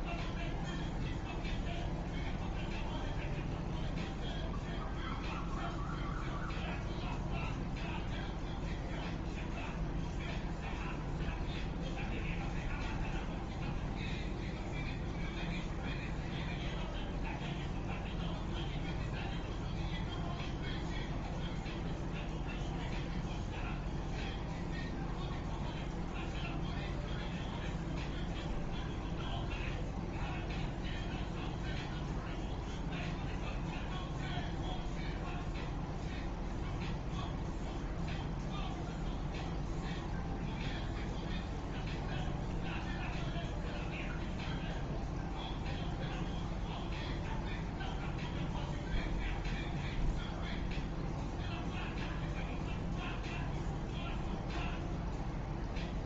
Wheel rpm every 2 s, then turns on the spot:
0, 0, 0, 0, 0, 0, 0, 0, 0, 0, 0, 0, 0, 0, 0, 0, 0, 0, 0, 0, 0, 0, 0, 0, 0, 0, 0, 0.
none